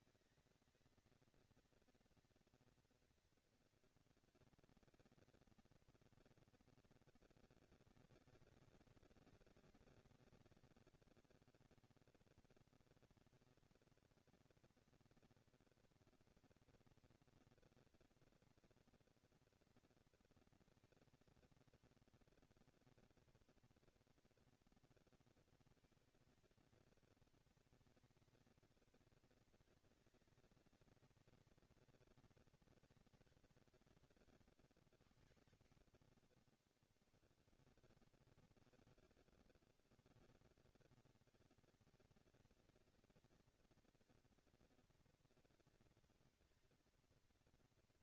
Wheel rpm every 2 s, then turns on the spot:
230, 230, 230, 220, 200, 200, 230, 230, 230, 230, 230, 230, 230, 220, 210, 220, 230, 150, 90, 100, 180, 220, 230, 230.
none